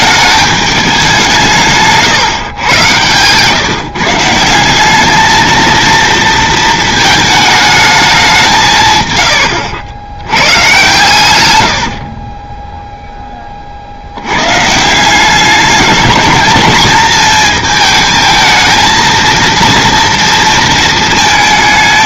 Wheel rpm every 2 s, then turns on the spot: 190, 110, 200, 220, 120, 120, 0, 150, 220, 220, 230.
8-10